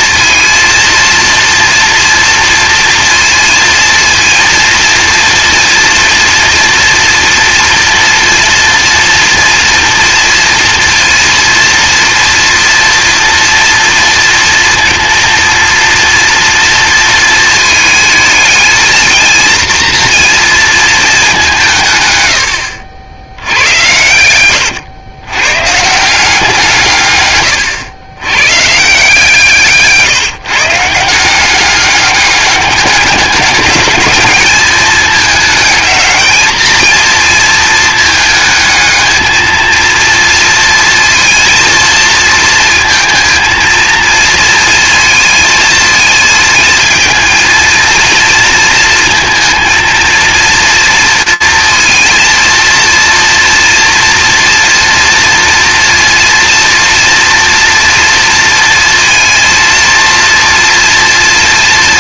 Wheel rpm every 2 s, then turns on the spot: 230, 230, 230, 230, 230, 230, 230, 230, 230, 220, 230, 100, 110, 180, 130, 160, 200, 210, 220, 220, 230, 230, 230, 220, 230, 230, 230, 230, 230, 230, 230.
none